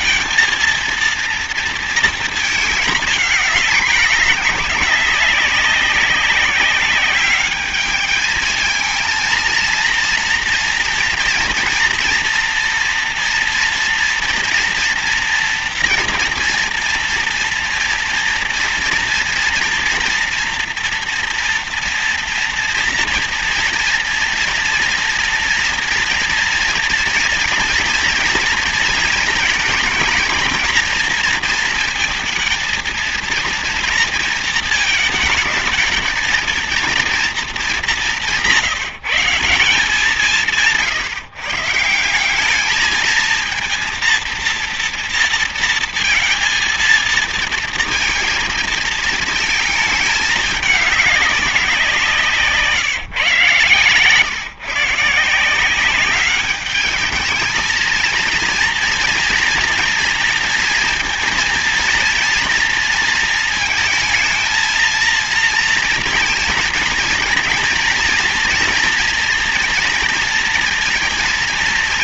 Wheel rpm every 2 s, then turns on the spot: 230, 220, 200, 190, 220, 230, 230, 230, 230, 230, 230, 230, 230, 230, 230, 230, 230, 230, 220, 180, 170, 200, 230, 230, 230, 220, 160, 130, 200, 230, 230, 230, 230, 220, 230, 230.
none